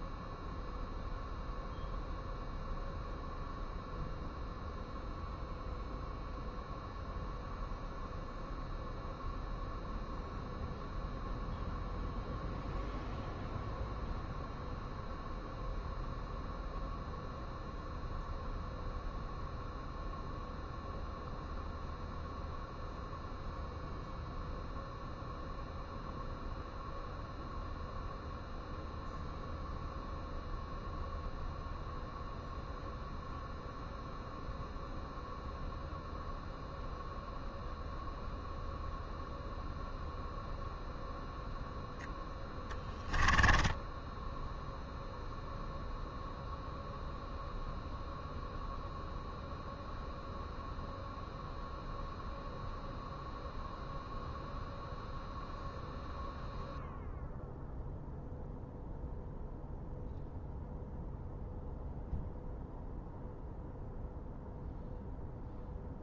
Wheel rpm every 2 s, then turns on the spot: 0, 0, 0, 0, 0, 0, 0, 0, 0, 0, 0, 0, 0, 0, 0, 0, 0, 0, 0, 0, 0, 10, 0, 0, 0, 0, 0, 0, 0, 0, 0, 0, 0.
42-44